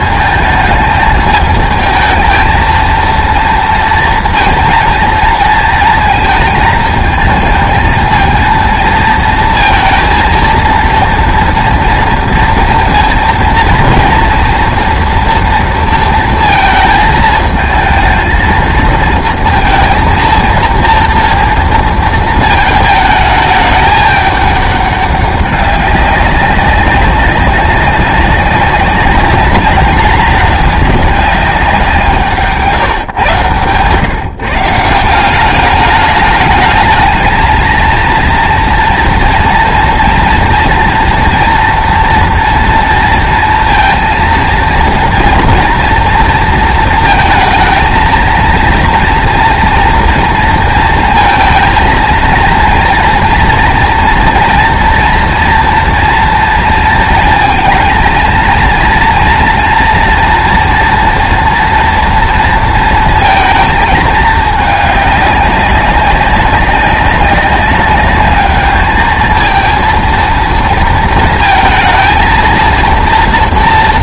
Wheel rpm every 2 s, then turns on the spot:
220, 220, 230, 220, 220, 230, 230, 240, 220, 220, 230, 220, 200, 200, 200, 210, 150, 150, 220, 240, 230, 230, 230, 230, 230, 230, 230, 240, 230, 240, 230, 230, 210, 200, 210, 230, 230.
none